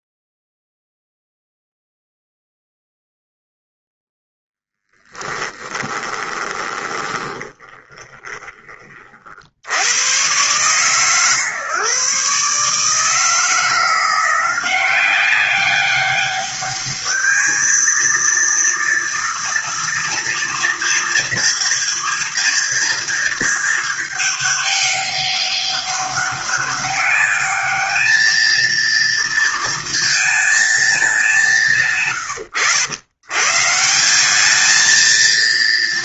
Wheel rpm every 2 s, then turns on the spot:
0, 0, 0, 20, 20, 120, 140, 180, 200, 230, 230, 230, 210, 200, 220, 220, 100, 210.
6-8